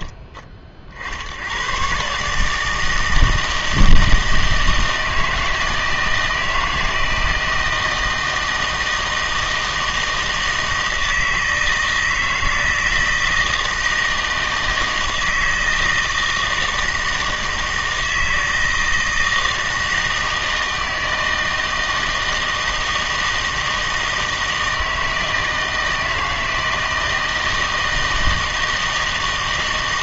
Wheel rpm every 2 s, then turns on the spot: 40, 160, 160, 160, 160, 160, 160, 160, 160, 160, 160, 160, 160, 160, 160.
none